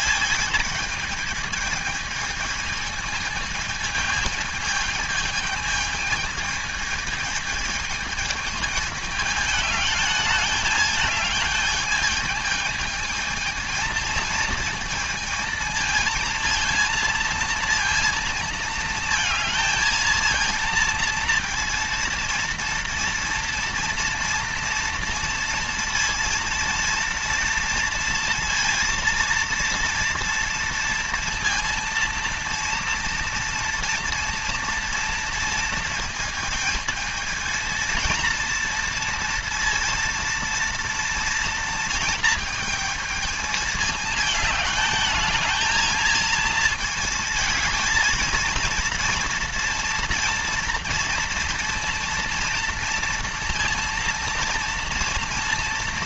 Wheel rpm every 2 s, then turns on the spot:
220, 220, 220, 220, 210, 210, 220, 230, 230, 230, 230, 230, 230, 230, 230, 230, 230, 230, 220, 230, 230, 220, 220, 220, 230, 230, 230, 230.
none